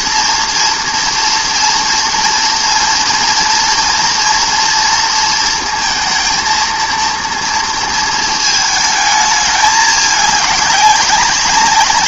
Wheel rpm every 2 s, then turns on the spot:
240, 230, 230, 230, 220, 200.
none